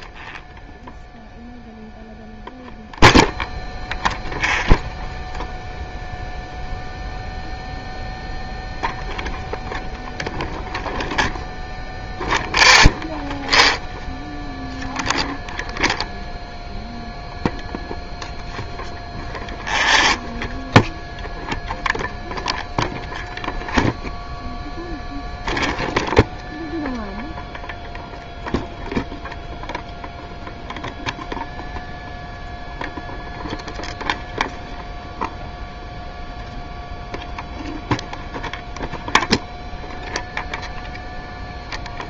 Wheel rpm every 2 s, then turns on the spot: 0, 0, 0, 0, 0, 0, 0, 0, 0, 0, 0, 0, 0, 0, 0, 0, 0, 0, 0, 0, 0.
none